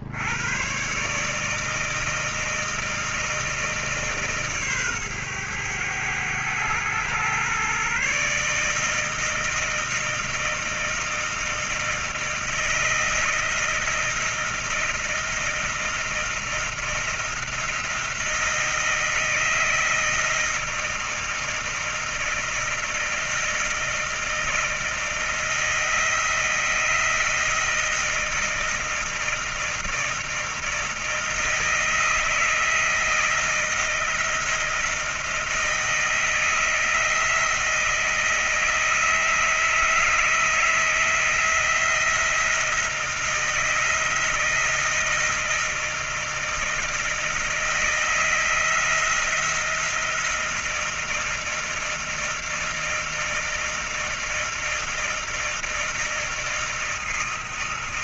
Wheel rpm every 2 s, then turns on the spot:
80, 160, 150, 110, 130, 160, 160, 160, 160, 170, 160, 160, 160, 160, 160, 160, 160, 160, 160, 160, 160, 170, 160, 160, 160, 170, 160, 160, 160.
none